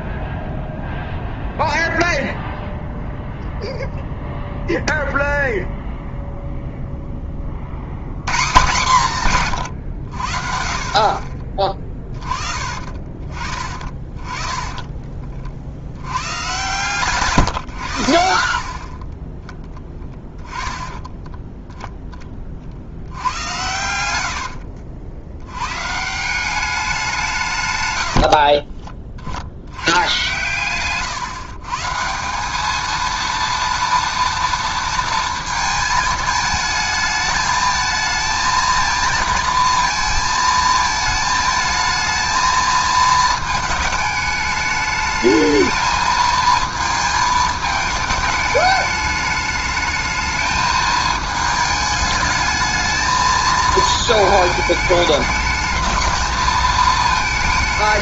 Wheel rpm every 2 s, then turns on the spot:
0, 0, 0, 0, 160, 50, 20, 20, 130, 50, 10, 50, 80, 190, 40, 120, 200, 230, 220, 220, 220, 220, 210, 220, 210, 220, 220, 220, 220.
14-16 24-26 28-32